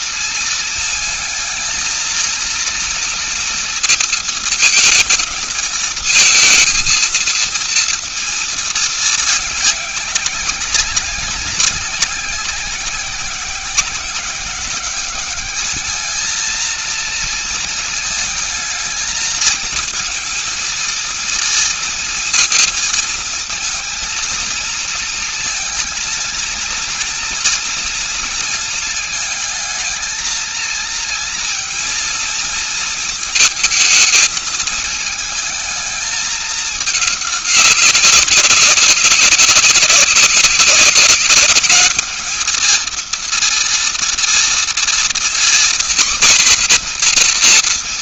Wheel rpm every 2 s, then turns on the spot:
230, 230, 230, 230, 230, 200, 190, 190, 230, 220, 230, 230, 230, 230, 230, 220, 230, 220, 210, 190, 190, 220, 230, 250.
none